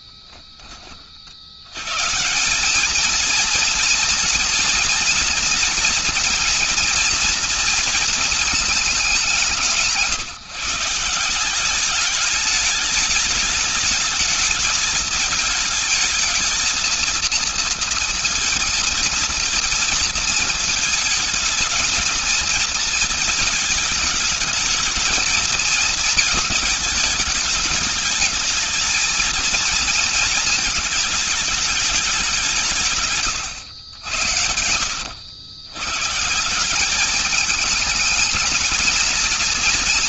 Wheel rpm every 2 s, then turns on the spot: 10, 160, 230, 240, 220, 150, 210, 220, 220, 230, 230, 230, 220, 230, 210, 220, 190, 90, 160, 220.
34-36